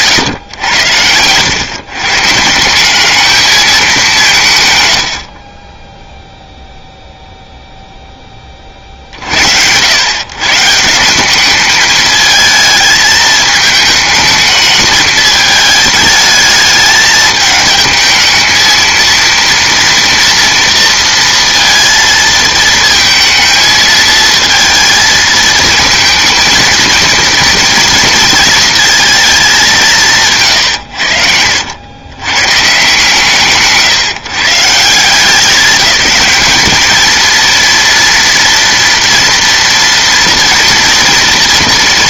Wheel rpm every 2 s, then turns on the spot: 110, 170, 120, 0, 40, 150, 220, 220, 220, 230, 230, 220, 230, 230, 230, 110, 140, 170, 220, 230, 240.
none